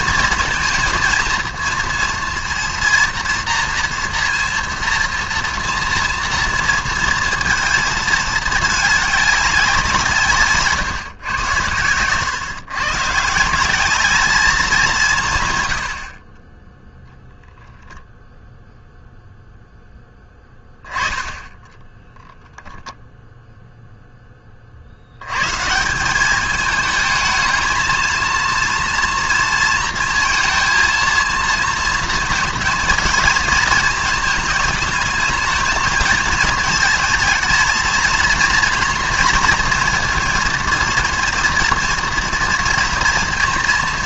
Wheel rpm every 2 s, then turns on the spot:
220, 230, 230, 230, 210, 140, 130, 180, 0, 0, 10, 0, 50, 210, 230, 230, 230, 220, 220, 230, 230, 230.
none